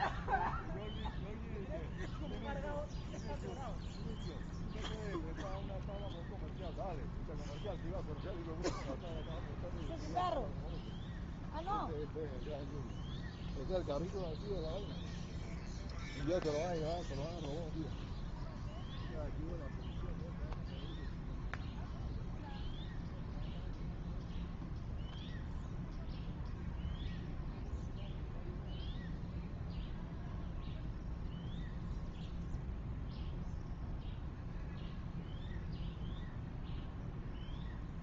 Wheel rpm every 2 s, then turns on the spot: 0, 0, 0, 0, 0, 0, 0, 0, 0, 0, 0, 0, 0, 0, 0, 0, 0, 0, 0.
none